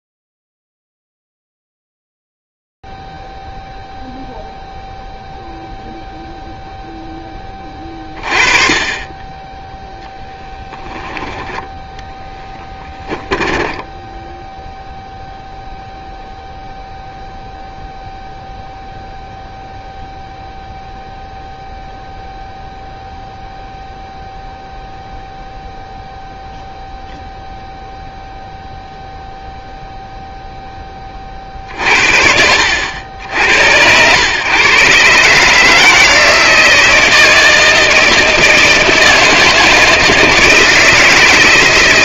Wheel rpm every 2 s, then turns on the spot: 0, 0, 0, 0, 20, 0, 10, 0, 0, 0, 0, 0, 0, 0, 0, 10, 70, 130, 160, 160, 160.
12-14